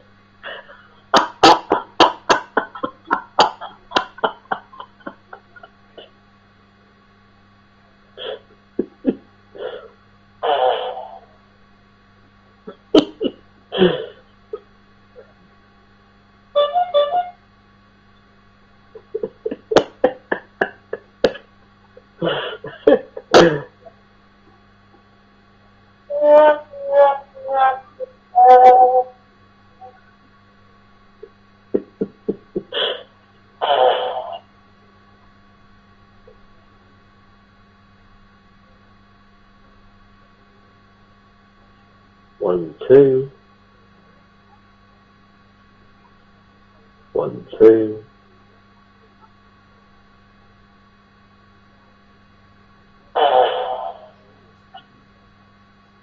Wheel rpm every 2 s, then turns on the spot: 0, 0, 0, 0, 0, 0, 0, 0, 0, 0, 0, 0, 0, 0, 0, 0, 0, 0, 0, 0, 0, 0, 0, 0, 0, 0, 0, 0.
none